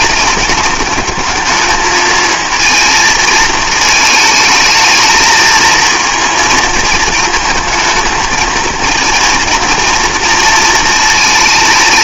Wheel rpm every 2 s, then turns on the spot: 210, 230, 220, 230, 220, 220.
none